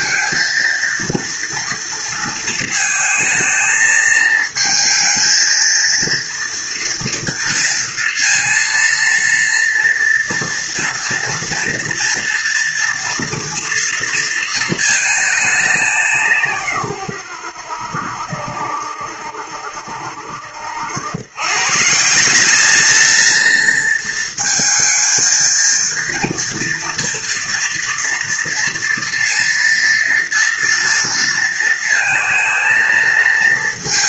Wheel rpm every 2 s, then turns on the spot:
230, 220, 220, 230, 230, 230, 230, 220, 130, 70, 90, 210, 230, 230, 230, 230, 230.
none